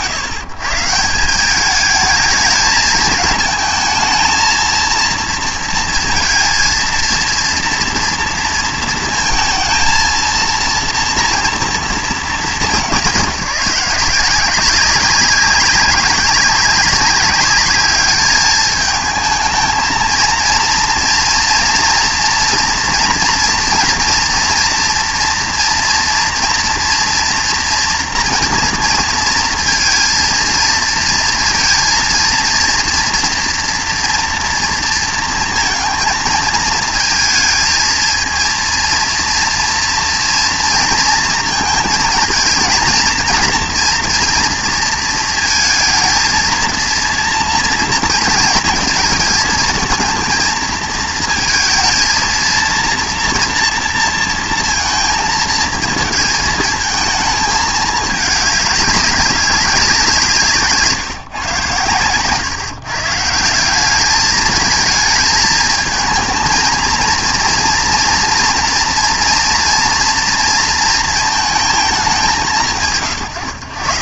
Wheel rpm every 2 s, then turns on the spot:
140, 220, 230, 230, 230, 230, 190, 190, 200, 210, 220, 230, 230, 240, 230, 230, 230, 230, 220, 230, 230, 230, 230, 230, 230, 220, 230, 230, 220, 200, 150, 150, 220, 230, 230, 220, 160.
none